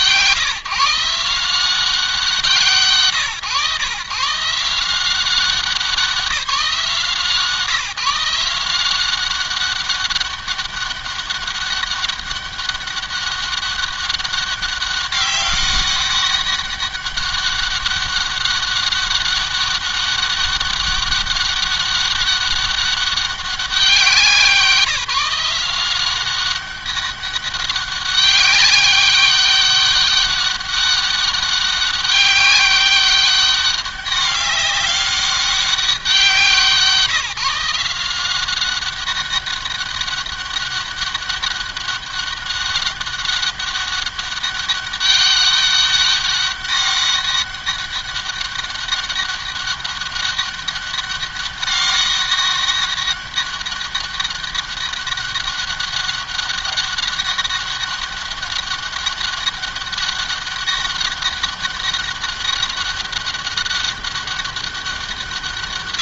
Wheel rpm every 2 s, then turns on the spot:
160, 160, 170, 170, 180, 200, 190, 200, 200, 200, 200, 200, 180, 200, 200, 200, 200, 200, 180, 190, 200, 200, 200, 200, 200, 200, 200, 200, 200, 200, 200, 200, 190.
none